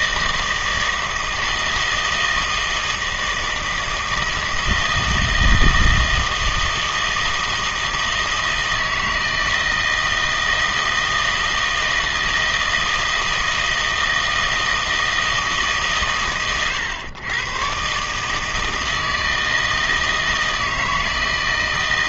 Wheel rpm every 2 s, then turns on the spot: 160, 160, 160, 160, 160, 160, 160, 160, 120, 160, 160.
none